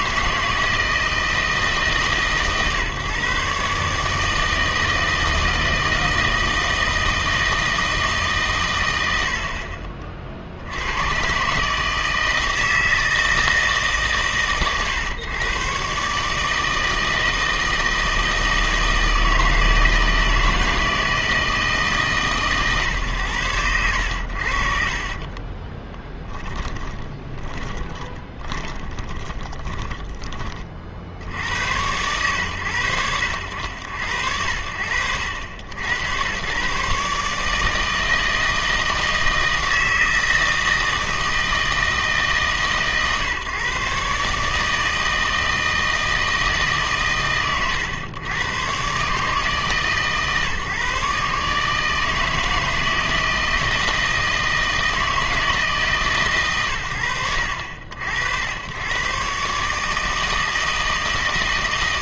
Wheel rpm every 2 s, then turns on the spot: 160, 140, 160, 160, 120, 80, 160, 130, 160, 160, 160, 120, 60, 30, 20, 40, 90, 70, 120, 160, 160, 150, 150, 150, 130, 150, 160, 160, 110, 90, 160.
26-30